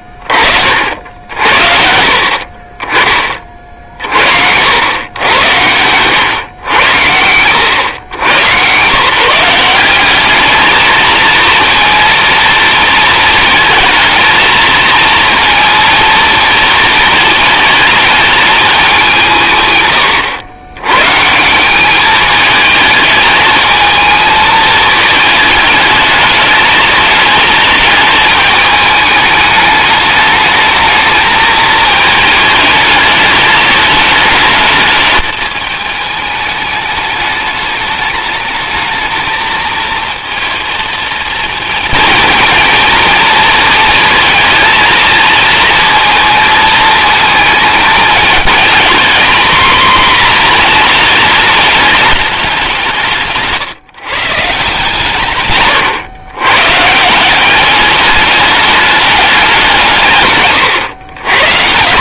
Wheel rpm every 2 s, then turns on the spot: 50, 40, 80, 100, 130, 220, 220, 230, 220, 200, 100, 220, 220, 210, 210, 220, 220, 220, 210, 210, 230, 230, 230, 220, 220, 220, 180, 150, 140, 210, 110.
none